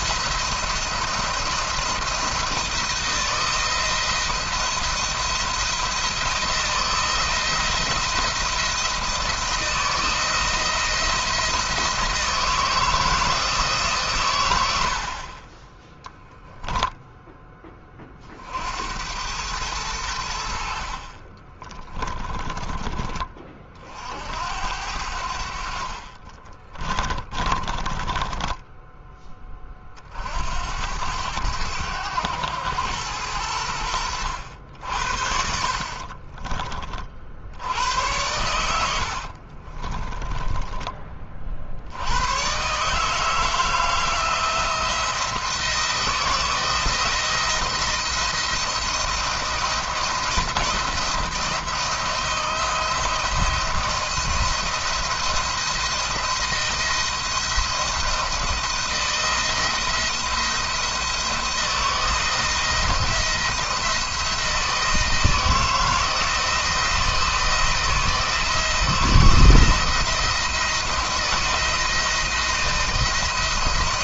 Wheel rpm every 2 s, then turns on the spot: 170, 170, 170, 170, 170, 170, 160, 110, 10, 60, 80, 30, 70, 30, 10, 70, 100, 80, 40, 100, 20, 120, 170, 160, 160, 170, 170, 170, 170, 160, 170, 160, 160, 160, 160, 160, 170.
20-24 26-30 38-42